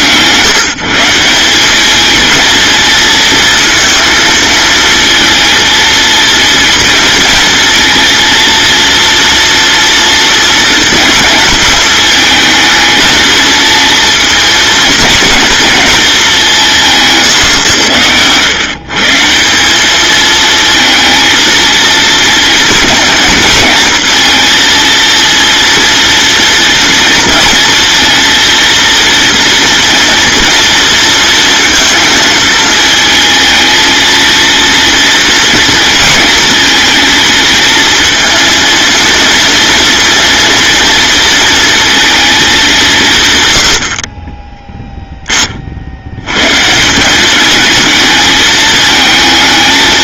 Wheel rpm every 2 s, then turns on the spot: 170, 230, 230, 230, 230, 230, 220, 230, 150, 160, 230, 230, 230, 230, 240, 230, 220, 230, 230, 230, 230, 140, 10, 190, 220.
none